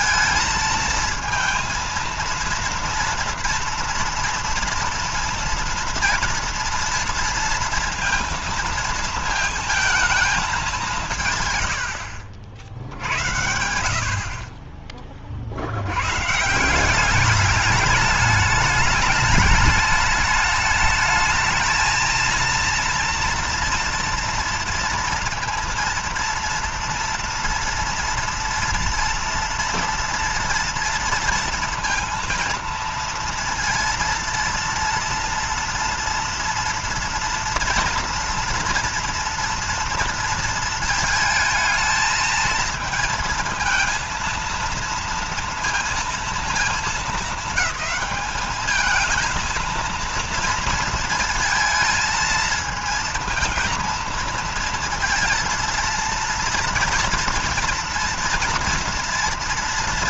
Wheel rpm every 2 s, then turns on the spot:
230, 230, 230, 230, 230, 180, 70, 30, 180, 210, 210, 230, 230, 230, 230, 230, 230, 230, 240, 230, 230, 230, 230, 220, 220, 230, 230, 230, 230, 230.
none